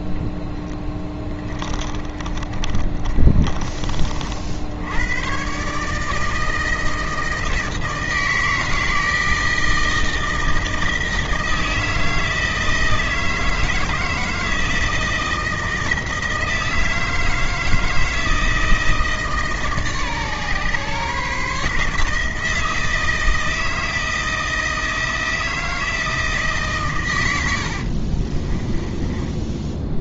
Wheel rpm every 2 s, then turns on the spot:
10, 40, 100, 160, 160, 160, 160, 160, 160, 160, 140, 160, 160, 120, 20.
0-4 28-30